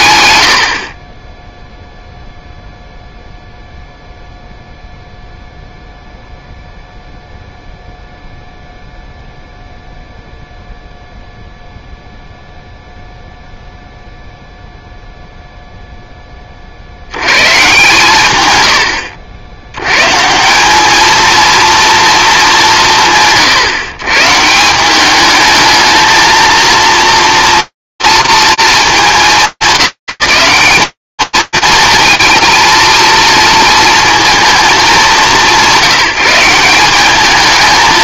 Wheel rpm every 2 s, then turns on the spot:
60, 0, 0, 0, 0, 0, 0, 0, 40, 100, 200, 170, 180, 230, 220, 210, 220, 230, 180.
none